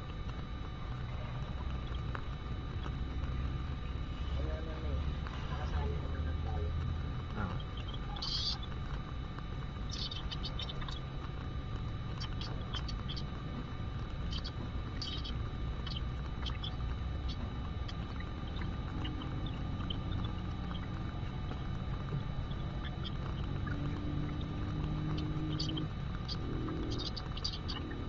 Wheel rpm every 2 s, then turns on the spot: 0, 0, 0, 0, 0, 0, 0, 0, 0, 0, 0, 0, 0, 0.
none